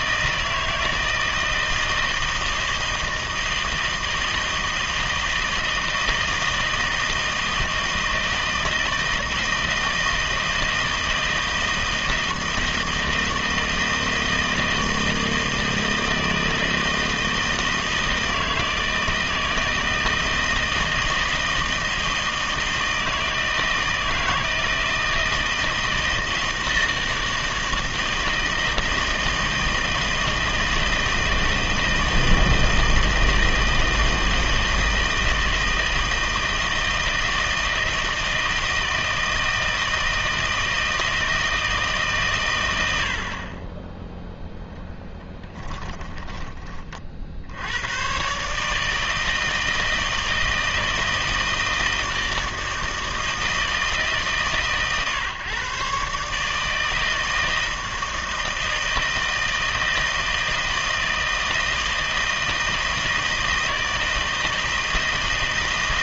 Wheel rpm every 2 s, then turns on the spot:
160, 160, 160, 160, 160, 160, 160, 160, 160, 160, 160, 160, 160, 160, 160, 160, 160, 160, 160, 160, 160, 30, 10, 70, 160, 160, 160, 140, 160, 160, 160, 160, 160.
44-46